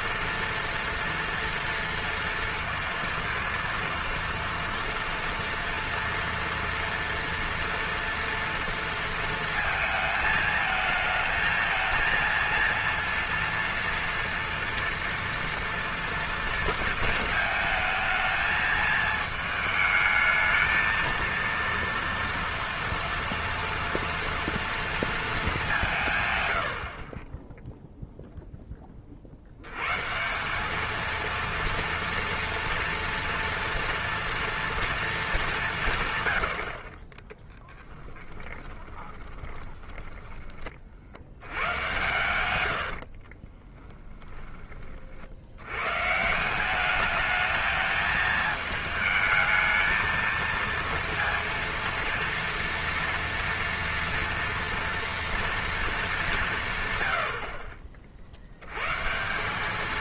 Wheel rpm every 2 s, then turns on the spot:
230, 230, 230, 230, 230, 220, 230, 230, 230, 220, 220, 230, 230, 100, 0, 180, 230, 230, 110, 20, 20, 100, 20, 170, 220, 230, 230, 230, 180, 70.
38-40